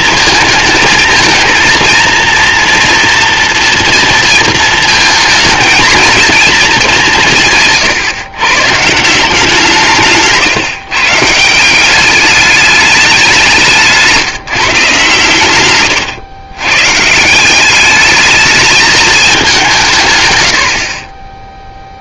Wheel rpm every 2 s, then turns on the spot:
220, 240, 230, 220, 150, 160, 210, 150, 130, 210, 70.
none